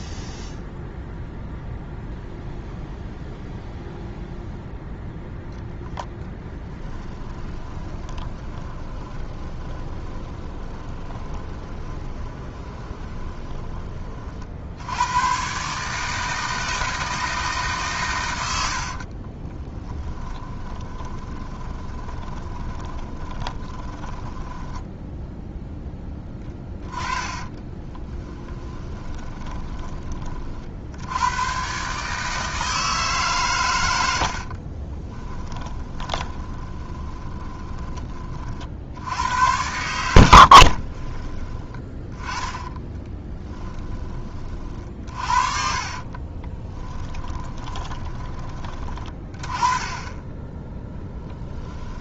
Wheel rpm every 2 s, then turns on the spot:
0, 0, 0, 10, 20, 20, 20, 80, 160, 70, 30, 20, 10, 10, 10, 70, 160, 40, 20, 70, 50, 10, 40, 20, 20, 10.
8-14 18-30 34-38 40-48 50-52